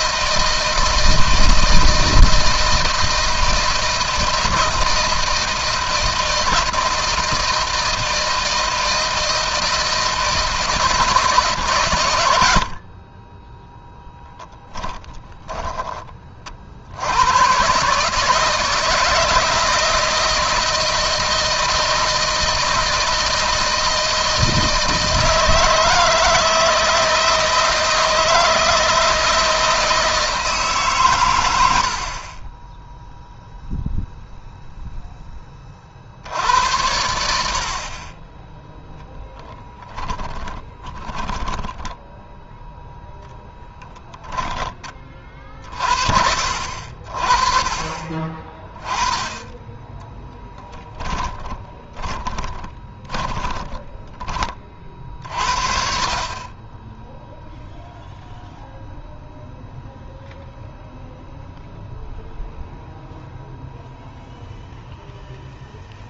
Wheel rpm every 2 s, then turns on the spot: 160, 170, 170, 160, 160, 150, 20, 10, 90, 160, 160, 170, 160, 160, 160, 130, 10, 0, 90, 10, 10, 0, 20, 50, 20, 10, 20, 30, 20, 0, 0, 0, 0.
14-16 40-42 52-54